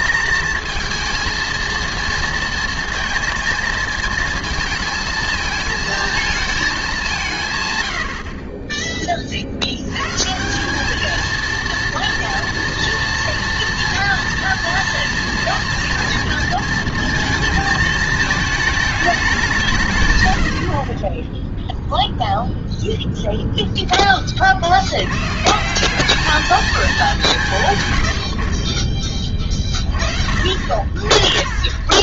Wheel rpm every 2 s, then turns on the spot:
230, 230, 220, 220, 30, 190, 230, 230, 230, 220, 70, 0, 50, 210, 50, 50.
none